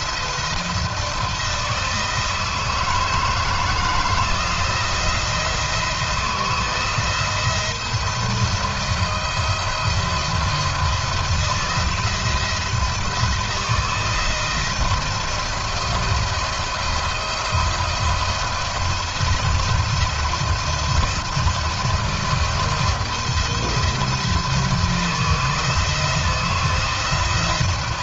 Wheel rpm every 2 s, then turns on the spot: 160, 160, 170, 170, 170, 170, 160, 160, 170, 170, 170, 170, 160, 170.
none